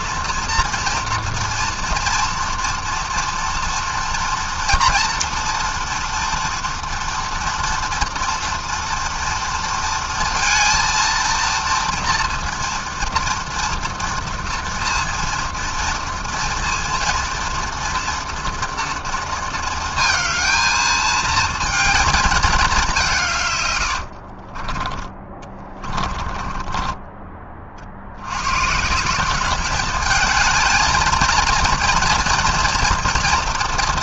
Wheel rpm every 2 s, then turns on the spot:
230, 230, 230, 230, 230, 230, 230, 230, 230, 230, 220, 160, 20, 30, 190, 220, 230.
24-26